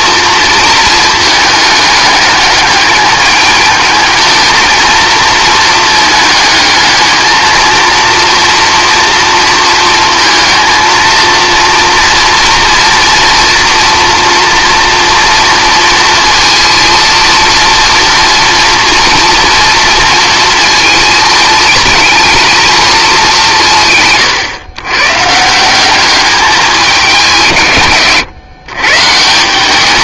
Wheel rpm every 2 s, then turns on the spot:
230, 210, 220, 220, 240, 230, 230, 230, 230, 240, 230, 230, 130, 210, 130.
none